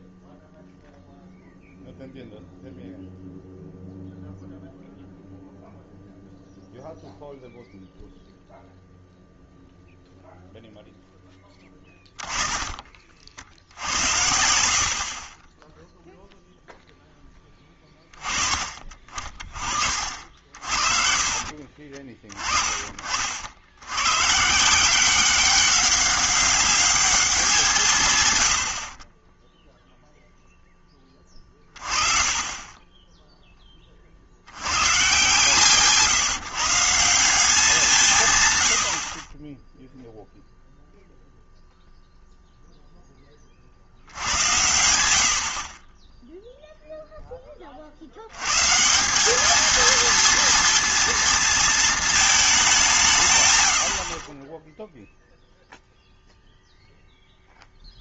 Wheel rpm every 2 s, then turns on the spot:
0, 0, 0, 0, 0, 0, 20, 60, 0, 30, 50, 30, 150, 200, 90, 10, 30, 100, 160, 120, 0, 0, 100, 0, 130, 230, 200, 0, 0.
none